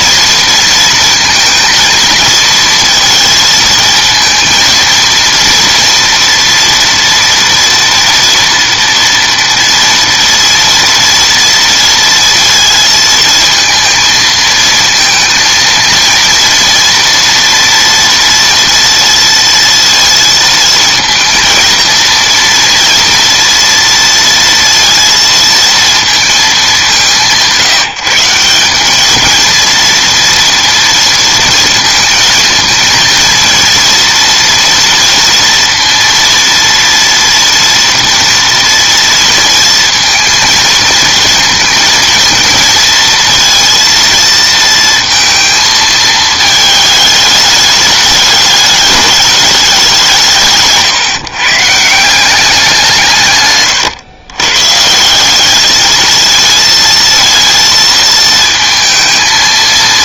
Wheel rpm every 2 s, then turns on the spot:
230, 230, 230, 230, 230, 230, 220, 230, 230, 230, 230, 230, 230, 180, 210, 230, 230, 230, 240, 230, 230, 230, 230, 210, 210, 150, 150, 180, 230, 220.
none